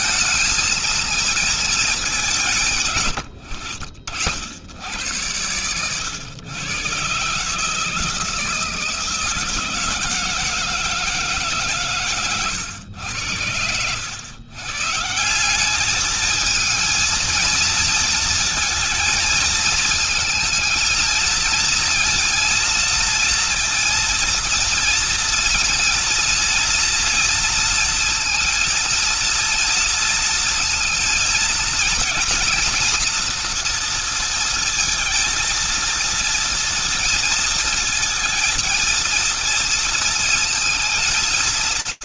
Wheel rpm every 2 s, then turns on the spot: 220, 160, 70, 110, 160, 160, 110, 110, 220, 230, 220, 230, 230, 230, 230, 230, 230, 230, 230, 230, 230.
none